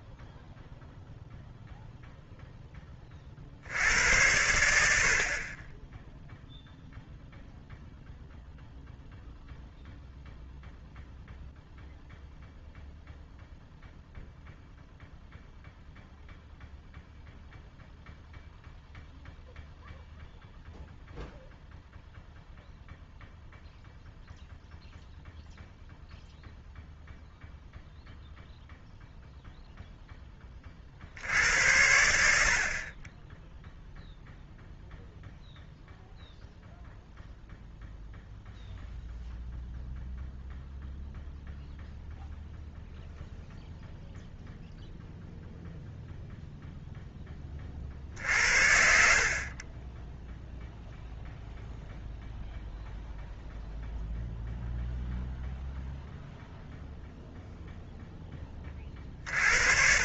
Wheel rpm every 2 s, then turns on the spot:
0, 0, 70, 0, 0, 0, 0, 0, 0, 0, 0, 0, 0, 0, 0, 60, 40, 0, 0, 0, 0, 0, 0, 0, 60, 0, 0, 0, 0, 40.
none